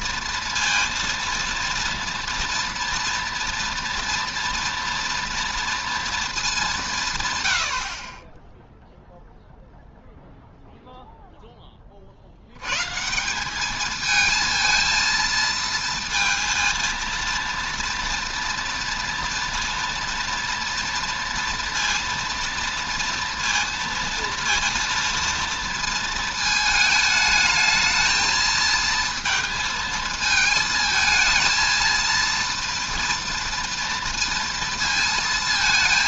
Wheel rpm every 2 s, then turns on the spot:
230, 240, 230, 190, 0, 0, 120, 230, 230, 230, 240, 230, 230, 220, 230, 220, 230, 230.
none